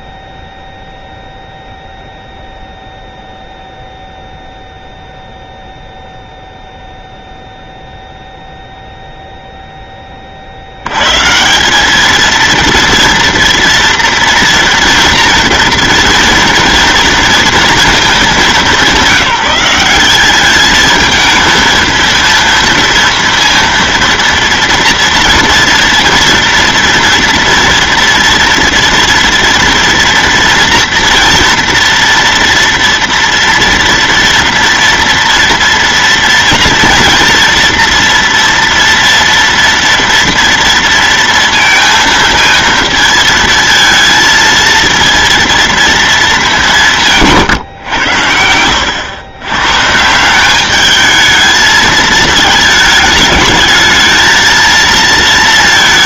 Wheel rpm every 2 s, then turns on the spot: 0, 0, 0, 0, 0, 70, 230, 230, 230, 200, 210, 230, 230, 230, 230, 230, 230, 230, 230, 230, 230, 230, 230, 200, 90, 200, 220, 220.
48-50